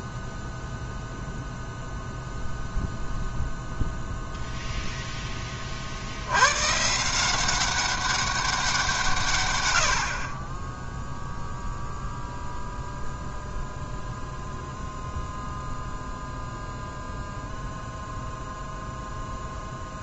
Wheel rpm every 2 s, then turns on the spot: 0, 0, 0, 120, 180, 10, 0, 0, 0, 0.
none